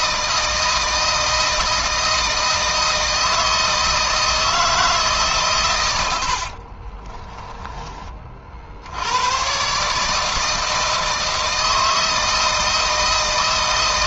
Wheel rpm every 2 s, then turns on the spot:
160, 160, 160, 30, 70, 160, 160.
6-8